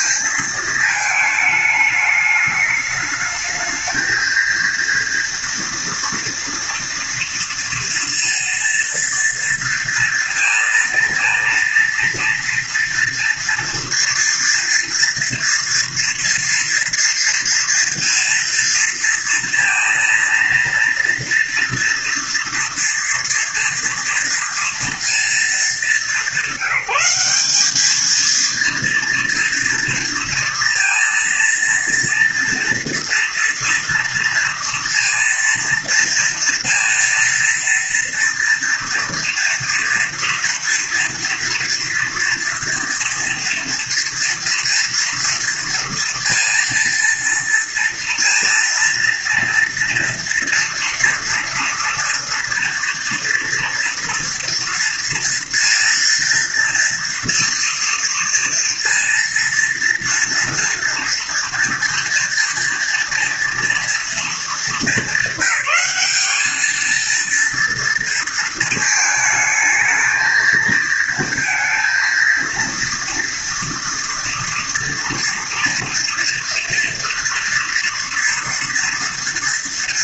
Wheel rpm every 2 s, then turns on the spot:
230, 210, 230, 230, 230, 230, 230, 230, 230, 230, 230, 230, 230, 180, 230, 230, 240, 230, 230, 230, 230, 230, 230, 230, 230, 240, 230, 230, 230, 230, 230, 230, 220, 210, 230, 220, 230, 230, 230, 230.
none